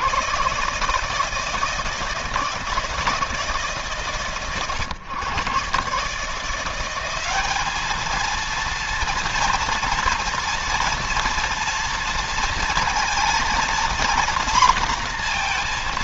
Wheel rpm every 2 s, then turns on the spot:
140, 160, 120, 180, 230, 230, 230, 240.
none